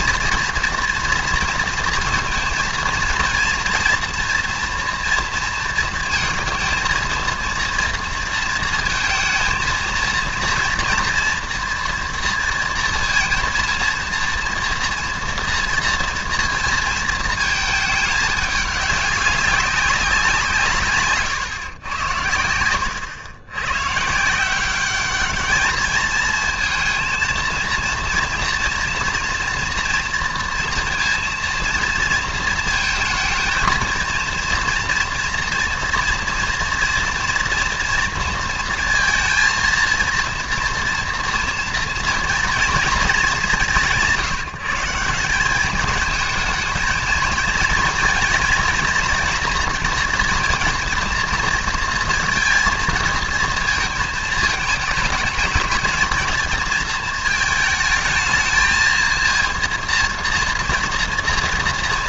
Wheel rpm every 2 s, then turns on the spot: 240, 230, 230, 230, 230, 240, 230, 240, 230, 200, 160, 90, 180, 220, 240, 230, 230, 230, 230, 230, 230, 240, 160, 230, 240, 230, 230, 220, 220, 220, 240.
none